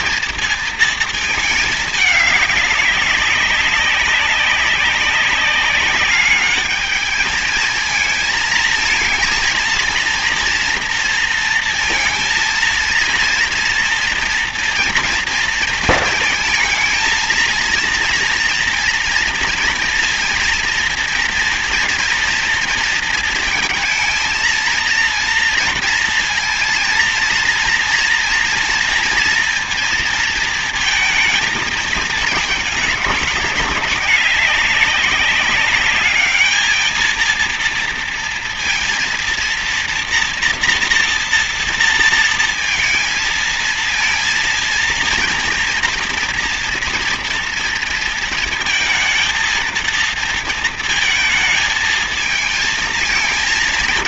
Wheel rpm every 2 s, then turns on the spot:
230, 200, 190, 210, 220, 230, 230, 230, 230, 230, 230, 230, 230, 230, 230, 220, 210, 200, 220, 230, 230, 230, 230, 230, 220, 220, 220.
none